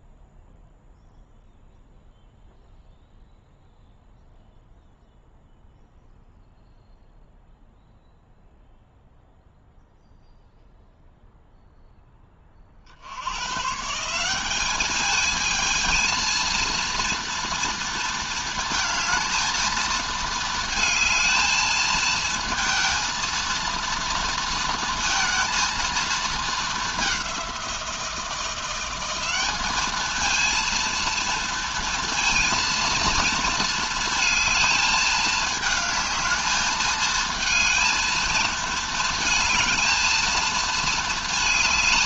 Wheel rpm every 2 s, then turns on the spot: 0, 0, 0, 0, 0, 0, 60, 210, 230, 220, 220, 230, 230, 210, 180, 230, 230, 220, 220, 220, 220.
none